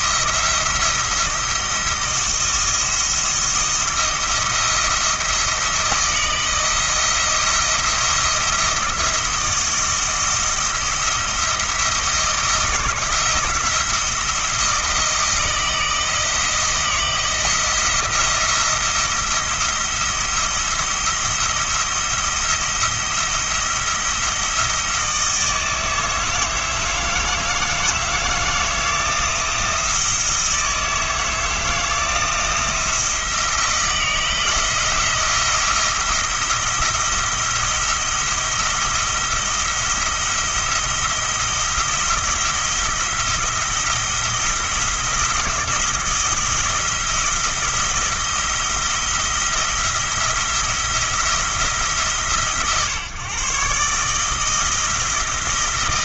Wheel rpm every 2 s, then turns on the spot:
170, 170, 170, 170, 170, 170, 170, 170, 170, 170, 170, 170, 160, 160, 160, 160, 170, 170, 170, 170, 170, 170, 170, 170, 170, 170, 140, 160.
none